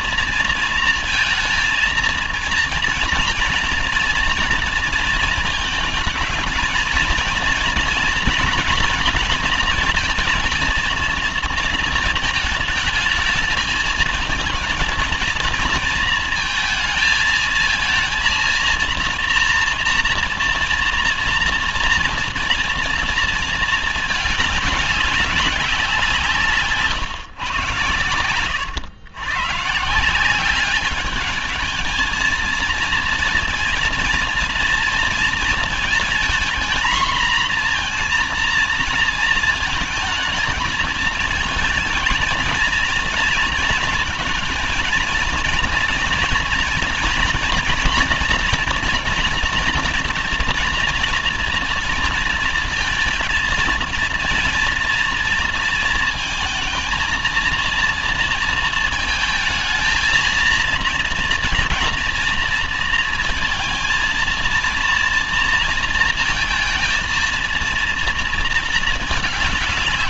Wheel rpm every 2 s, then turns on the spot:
230, 230, 240, 220, 240, 230, 220, 230, 230, 230, 230, 230, 210, 160, 110, 190, 220, 230, 230, 230, 230, 230, 220, 230, 230, 230, 230, 230, 220, 230, 230, 230, 230, 230, 230.
none